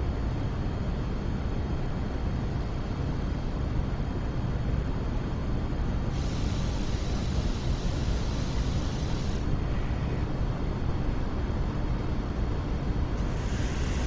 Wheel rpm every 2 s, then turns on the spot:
0, 0, 0, 0, 10, 10, 0.
none